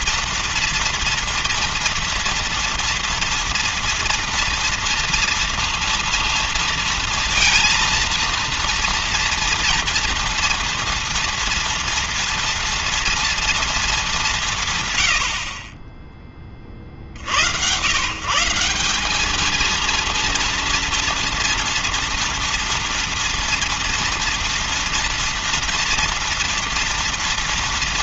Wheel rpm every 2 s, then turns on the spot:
230, 230, 230, 230, 230, 230, 230, 160, 30, 160, 230, 230, 240, 230.
none